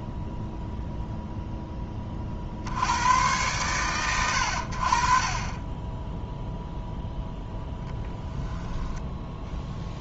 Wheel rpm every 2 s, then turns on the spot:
0, 90, 60, 0, 0.
none